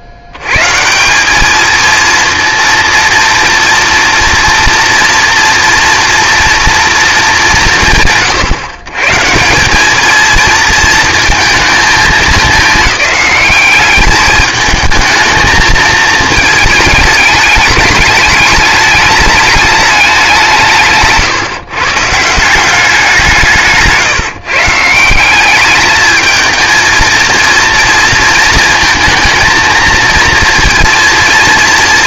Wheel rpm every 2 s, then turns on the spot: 160, 230, 230, 230, 140, 230, 210, 220, 220, 210, 150, 180, 170, 230, 230, 230.
none